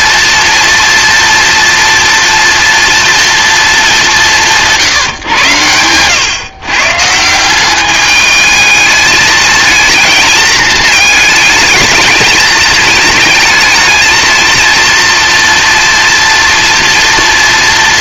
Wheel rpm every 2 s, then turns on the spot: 230, 230, 160, 130, 220, 220, 220, 230, 230.
4-6